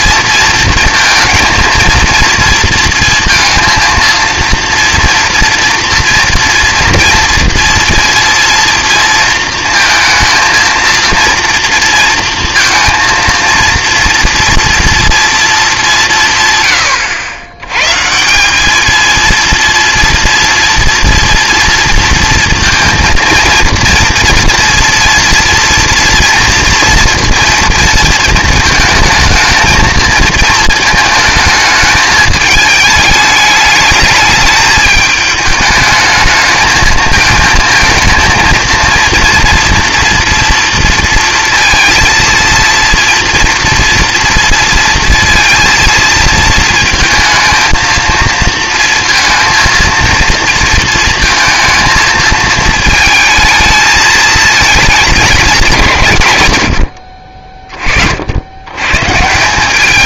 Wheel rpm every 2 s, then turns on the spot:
220, 230, 230, 240, 230, 230, 230, 230, 110, 200, 230, 230, 230, 230, 220, 220, 220, 210, 220, 230, 230, 230, 230, 230, 230, 230, 220, 220, 100, 100.
none